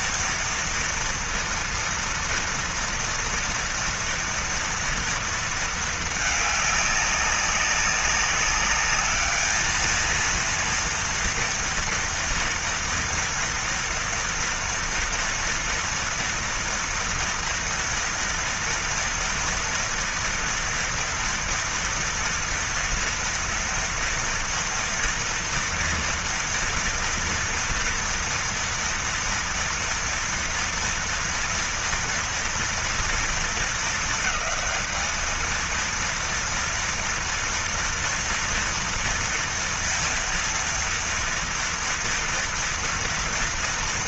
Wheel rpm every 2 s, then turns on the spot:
230, 230, 240, 220, 200, 220, 230, 230, 230, 230, 230, 230, 230, 230, 230, 230, 230, 220, 230, 230, 230, 230.
none